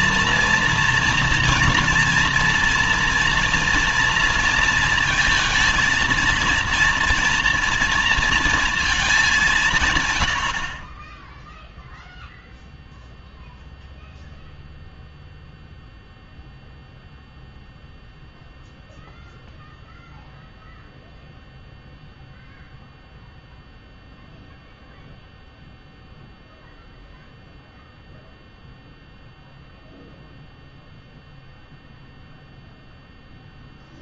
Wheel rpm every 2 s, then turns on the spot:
240, 230, 230, 230, 230, 80, 0, 0, 0, 0, 0, 0, 0, 0, 0, 0, 0.
none